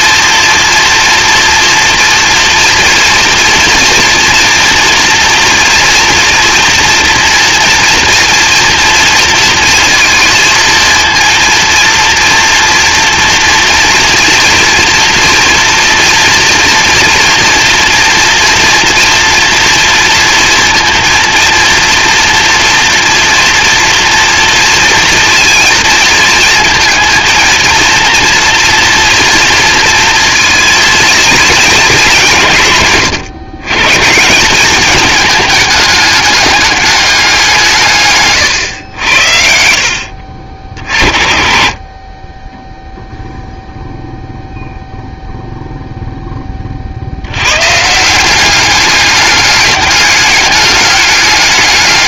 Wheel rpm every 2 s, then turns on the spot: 240, 230, 230, 230, 230, 230, 230, 240, 230, 240, 230, 230, 230, 230, 230, 220, 150, 210, 210, 110, 50, 10, 0, 30, 200, 200.
none